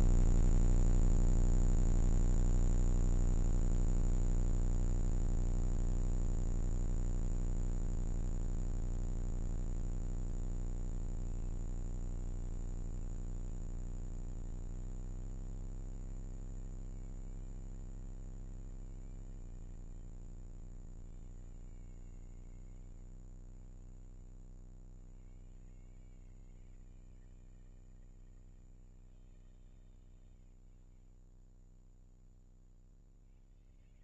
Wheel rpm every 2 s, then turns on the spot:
0, 40, 150, 160, 160, 150, 160, 160, 160, 160, 160, 70, 110, 160, 150, 30, 70.
30-32